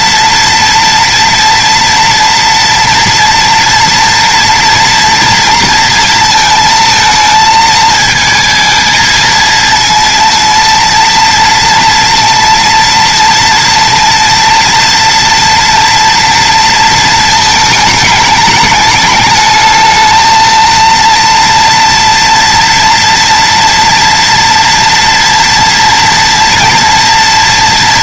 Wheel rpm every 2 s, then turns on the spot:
240, 230, 230, 230, 220, 230, 230, 230, 230, 210, 230, 230, 230, 230.
none